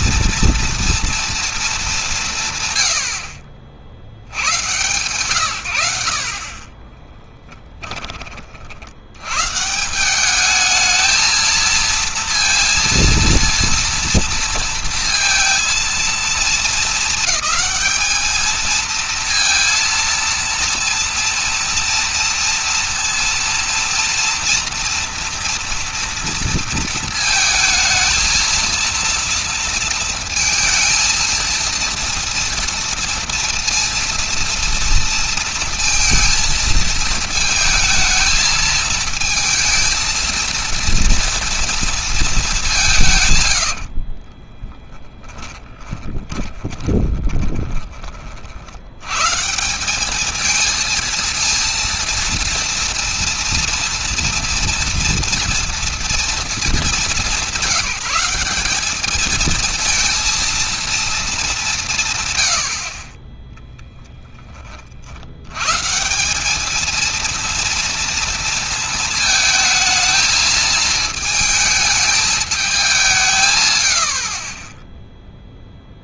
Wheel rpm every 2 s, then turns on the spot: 230, 110, 110, 30, 70, 210, 230, 230, 220, 220, 230, 230, 230, 230, 230, 230, 230, 230, 230, 220, 230, 180, 10, 20, 80, 220, 240, 230, 200, 190, 230, 80, 30, 210, 230, 220, 190, 20.
6-8 44-48